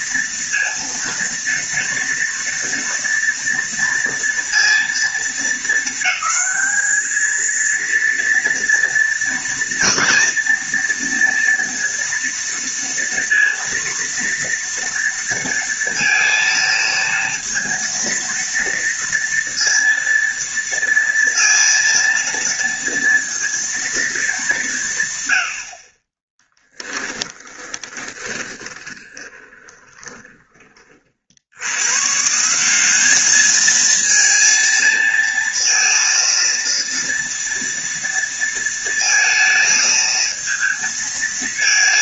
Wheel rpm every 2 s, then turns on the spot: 230, 230, 230, 220, 230, 230, 230, 230, 230, 230, 230, 230, 190, 10, 20, 30, 160, 230, 230, 230, 220.
26-30